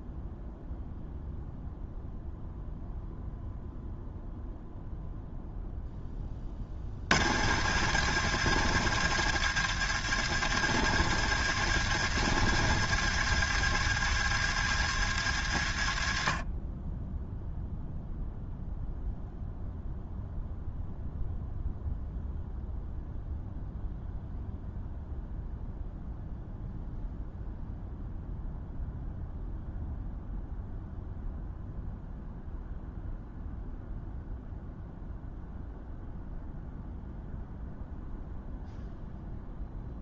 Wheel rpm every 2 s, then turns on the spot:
0, 0, 0, 60, 120, 120, 120, 110, 10, 0, 0, 0, 0, 0, 0, 0, 0, 0, 0, 0.
none